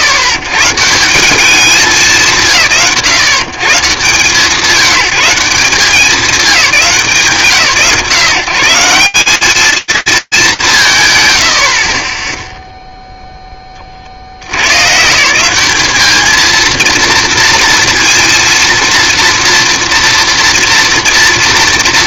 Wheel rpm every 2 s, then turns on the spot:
120, 140, 160, 190, 180, 190, 0, 110, 230, 230, 230.
none